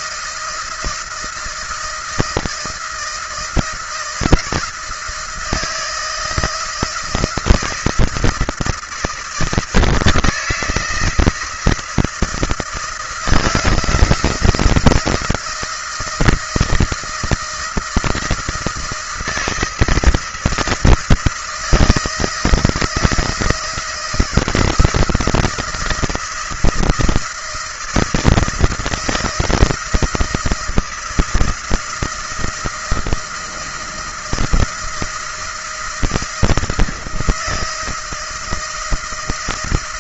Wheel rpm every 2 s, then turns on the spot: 160, 170, 160, 160, 160, 170, 160, 160, 170, 160, 160, 160, 160, 160, 160, 160, 160, 170, 160, 170.
none